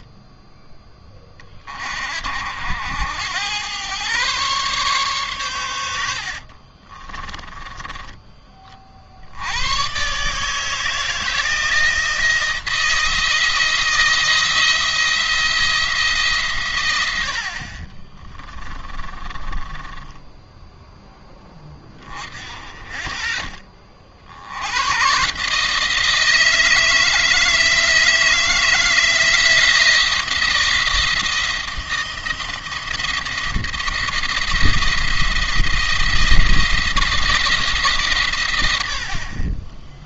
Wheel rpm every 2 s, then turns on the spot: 10, 70, 130, 60, 40, 150, 170, 170, 110, 30, 20, 20, 90, 160, 160, 170, 170, 170, 170, 90.
6-8 18-22